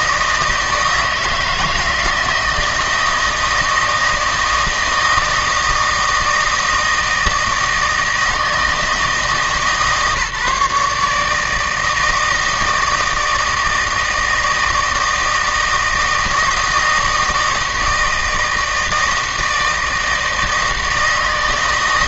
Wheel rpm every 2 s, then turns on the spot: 160, 160, 160, 160, 160, 150, 160, 160, 160, 160, 160.
none